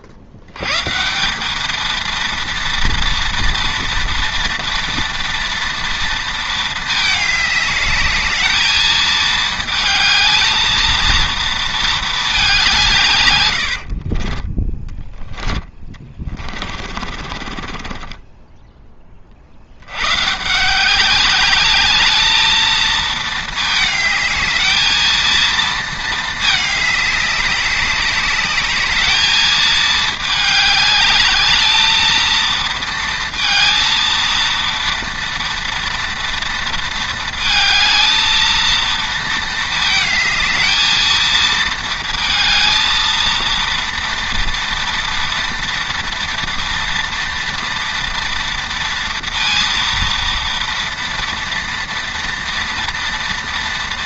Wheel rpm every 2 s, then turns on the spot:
130, 230, 230, 210, 220, 230, 160, 20, 40, 10, 180, 220, 220, 210, 210, 210, 230, 230, 230, 230, 220, 230, 230, 230, 230, 230, 230.
14-18